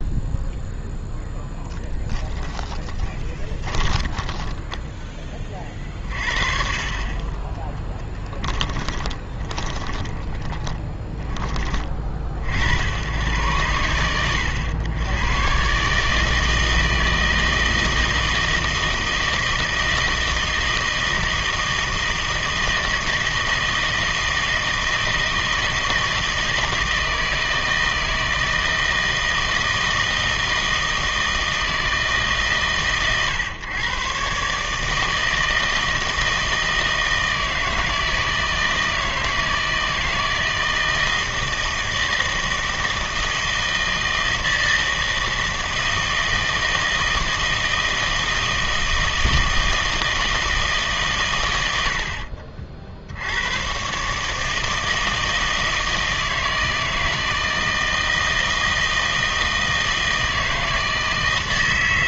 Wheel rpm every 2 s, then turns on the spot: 0, 10, 10, 40, 20, 30, 70, 100, 160, 160, 160, 160, 160, 160, 160, 160, 140, 150, 160, 160, 160, 160, 160, 160, 160, 150, 60, 160, 160, 160, 160.
2-6 8-12